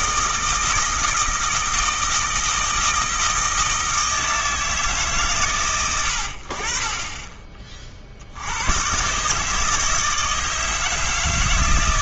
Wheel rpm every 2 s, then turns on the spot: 160, 160, 150, 40, 130, 160.
none